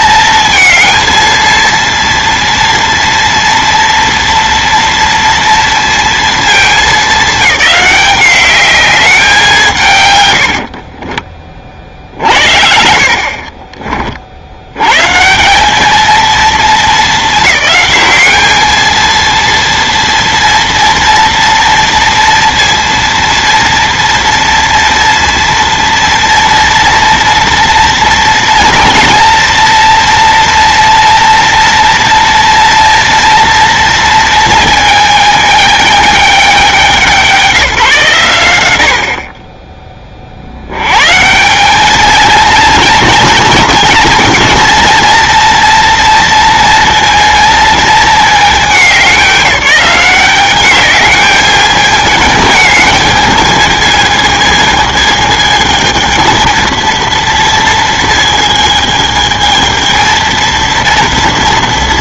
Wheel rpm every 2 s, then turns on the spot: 230, 230, 230, 220, 200, 60, 60, 90, 230, 220, 240, 230, 230, 230, 230, 230, 230, 230, 200, 90, 80, 230, 230, 230, 210, 200, 220, 220, 230, 220, 230.
10-12